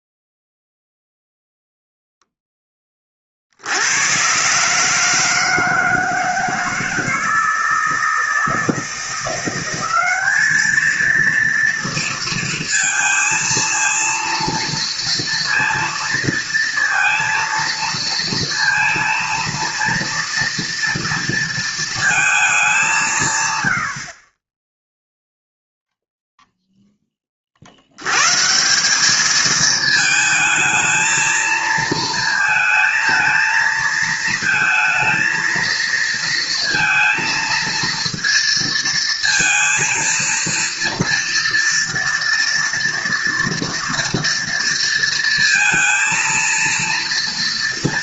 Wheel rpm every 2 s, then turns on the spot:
0, 0, 130, 160, 160, 210, 230, 230, 230, 230, 230, 200, 20, 0, 150, 220, 220, 230, 230, 230, 230, 240, 230, 230.
none